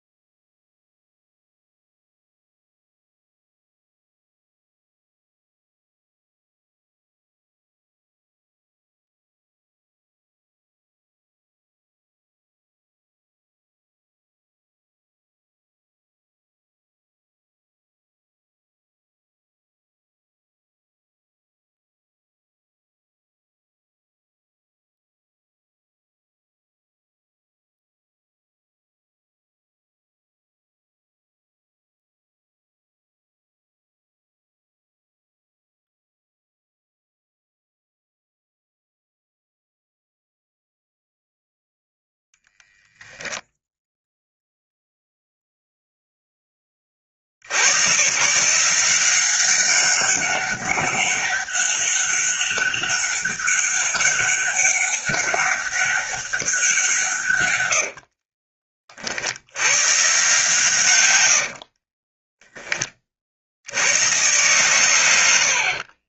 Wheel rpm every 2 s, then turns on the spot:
0, 0, 0, 0, 0, 0, 0, 0, 0, 0, 0, 0, 0, 0, 0, 0, 0, 0, 0, 0, 0, 0, 0, 20, 160, 200, 200, 200, 170, 40, 130, 20, 120.
none